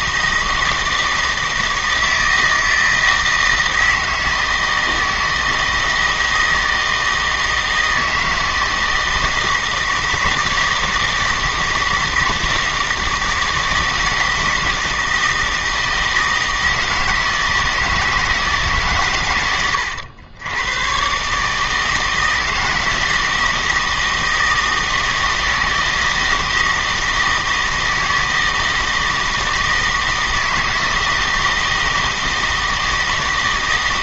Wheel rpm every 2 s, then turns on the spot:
160, 160, 160, 160, 160, 160, 170, 160, 160, 140, 110, 160, 160, 160, 160, 160, 160.
none